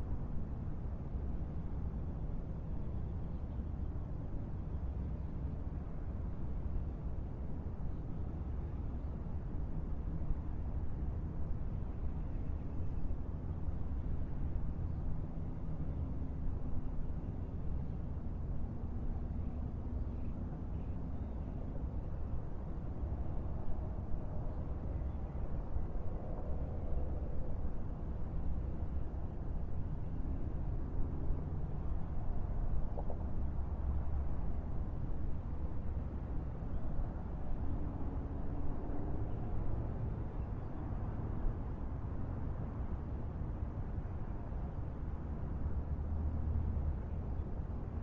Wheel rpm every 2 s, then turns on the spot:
0, 0, 0, 0, 0, 0, 0, 0, 0, 0, 0, 0, 0, 0, 0, 0, 0, 0, 0, 0, 0, 0, 0, 0.
none